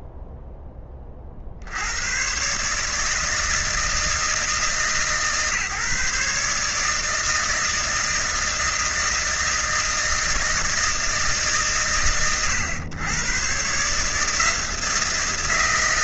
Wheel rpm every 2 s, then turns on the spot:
10, 140, 160, 160, 160, 160, 120, 160.
none